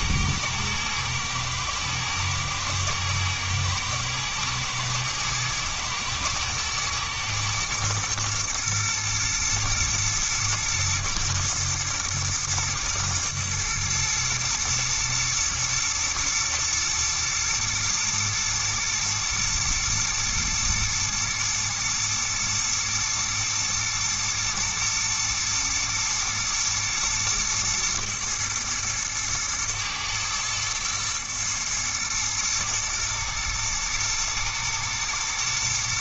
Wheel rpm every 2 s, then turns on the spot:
120, 110, 120, 120, 120, 110, 110, 110, 110, 120, 120, 110, 110, 110, 110, 110, 120, 110.
none